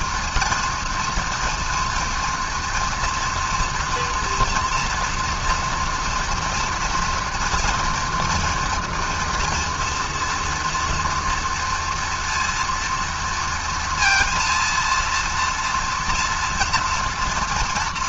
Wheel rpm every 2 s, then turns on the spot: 240, 230, 230, 230, 230, 230, 230, 230, 230.
none